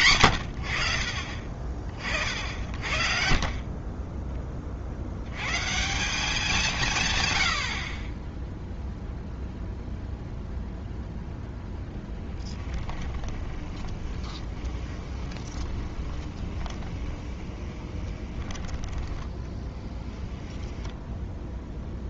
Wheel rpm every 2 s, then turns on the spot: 70, 60, 40, 170, 0, 0, 20, 20, 20, 20, 10.
12-18